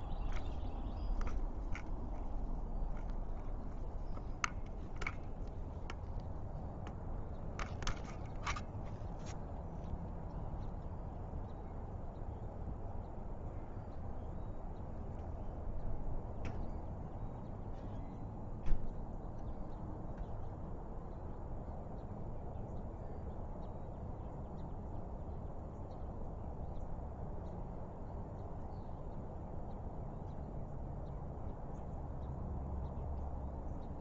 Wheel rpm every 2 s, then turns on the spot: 0, 0, 0, 0, 0, 0, 0, 0, 0, 0, 0, 0, 0, 0, 0, 0, 0.
none